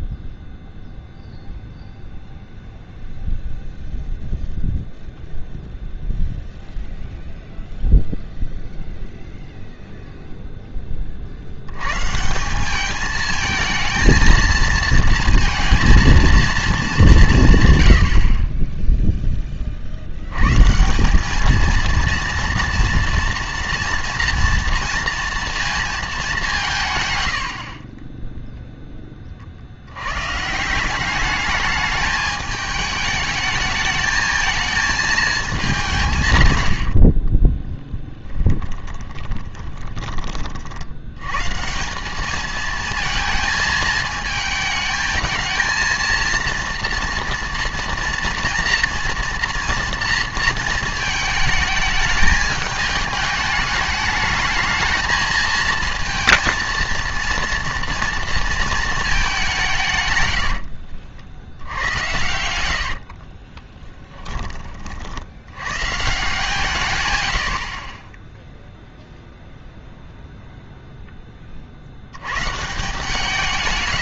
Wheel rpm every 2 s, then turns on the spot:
0, 0, 0, 0, 0, 10, 190, 230, 210, 20, 140, 230, 230, 170, 0, 160, 210, 220, 90, 30, 50, 220, 220, 230, 230, 220, 210, 220, 230, 230, 70, 80, 30, 140, 0, 0, 140.
36-40 60-64